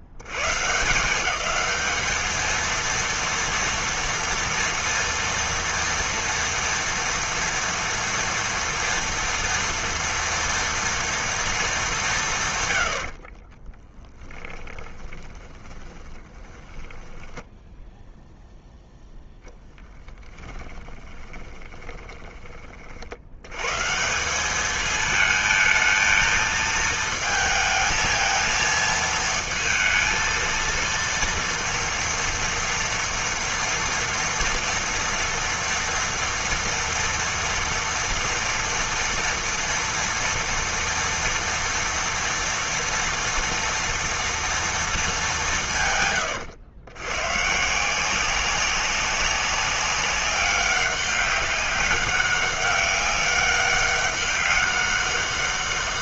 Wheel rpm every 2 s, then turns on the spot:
80, 220, 230, 230, 230, 230, 130, 20, 20, 0, 20, 20, 200, 220, 220, 230, 230, 230, 230, 230, 230, 230, 230, 100, 190, 200, 200, 200.
14-18 20-22